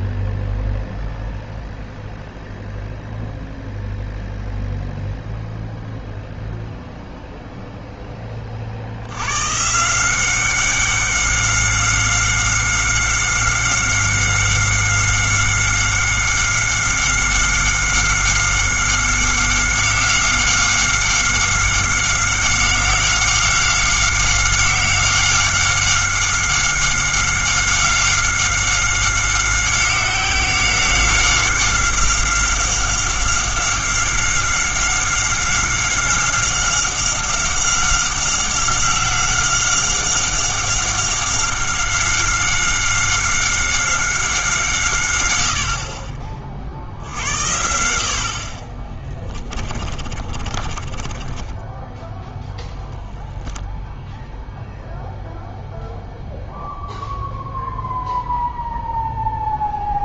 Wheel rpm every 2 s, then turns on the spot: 0, 0, 0, 0, 50, 190, 190, 190, 190, 190, 190, 190, 190, 190, 190, 190, 190, 190, 190, 190, 190, 190, 150, 50, 40, 40, 0, 0, 0, 0.
50-52